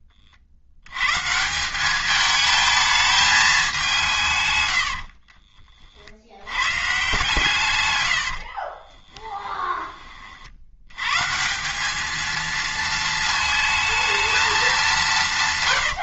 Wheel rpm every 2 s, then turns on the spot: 80, 220, 90, 120, 40, 80, 230, 210.
4-6 8-10